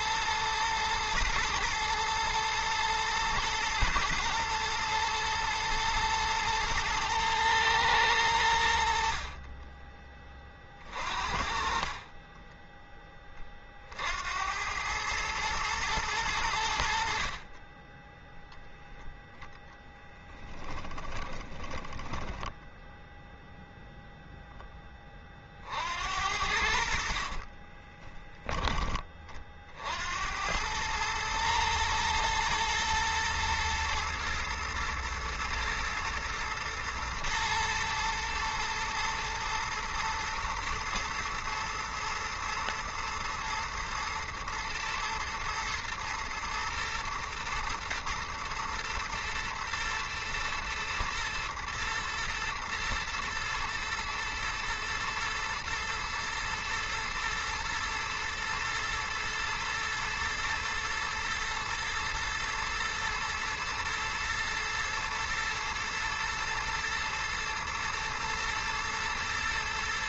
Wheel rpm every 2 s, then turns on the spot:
120, 110, 110, 110, 60, 40, 20, 110, 60, 0, 10, 0, 20, 50, 30, 110, 110, 110, 110, 110, 120, 120, 110, 120, 110, 120, 120, 120, 120, 120, 110, 110, 120, 120, 110.
8-10 20-22 26-28